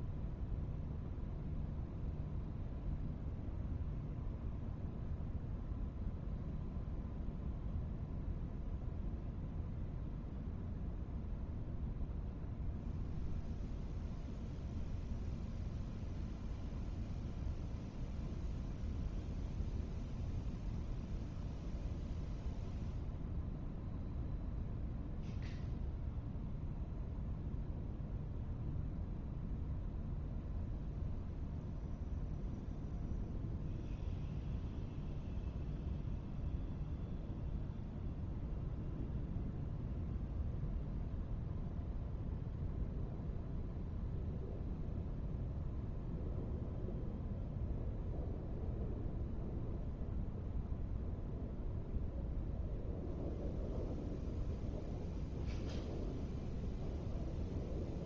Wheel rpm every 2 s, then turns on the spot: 0, 0, 0, 0, 0, 0, 0, 0, 0, 0, 0, 0, 0, 0, 0, 0, 0, 0, 0, 0, 0, 0, 0, 0, 0, 0, 0, 0, 0.
none